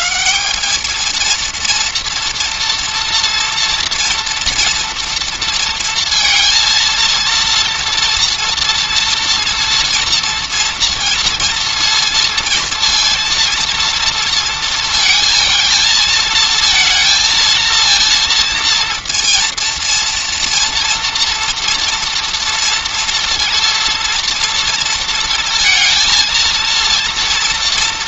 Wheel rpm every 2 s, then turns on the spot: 220, 230, 230, 230, 230, 230, 230, 230, 230, 230, 230, 230, 230, 230.
none